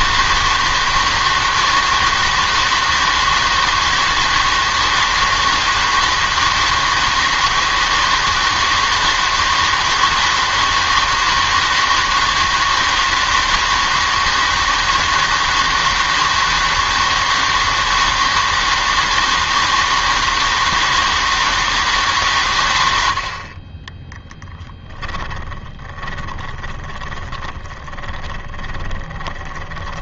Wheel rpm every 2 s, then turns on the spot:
160, 160, 160, 160, 160, 160, 160, 160, 160, 160, 160, 120, 10, 20, 20.
26-30